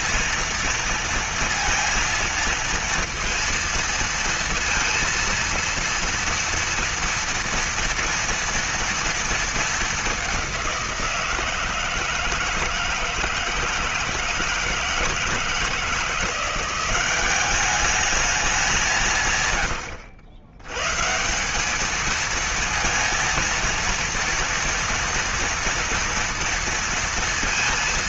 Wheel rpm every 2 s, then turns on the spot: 230, 230, 230, 230, 240, 190, 160, 160, 180, 200, 120, 230, 230, 230.
none